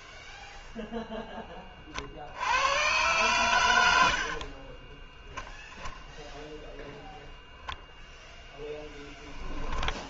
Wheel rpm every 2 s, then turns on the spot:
0, 80, 60, 0, 0.
4-6